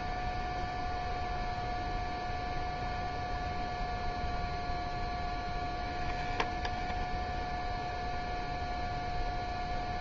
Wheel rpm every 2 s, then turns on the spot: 0, 0, 0, 0, 0.
none